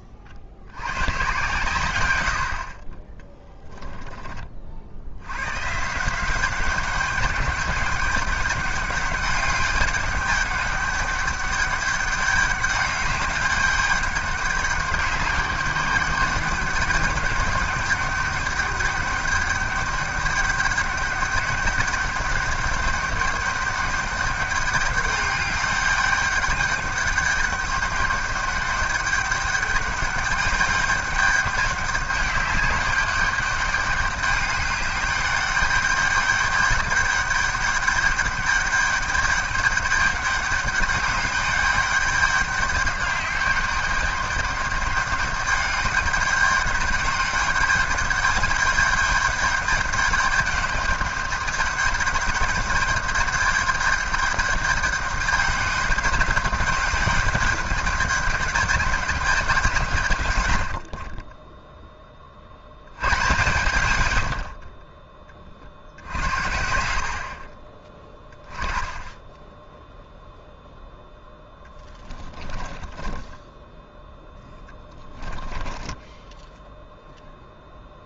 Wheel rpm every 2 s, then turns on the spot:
100, 50, 70, 190, 200, 200, 200, 200, 200, 200, 200, 200, 200, 200, 200, 200, 200, 200, 200, 200, 200, 200, 200, 200, 210, 200, 200, 200, 210, 210, 80, 90, 40, 60, 10, 0, 10, 10, 10.
60-62 72-76